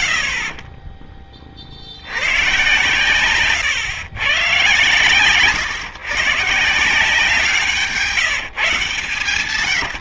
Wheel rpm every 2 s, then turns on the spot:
70, 120, 130, 160, 160.
none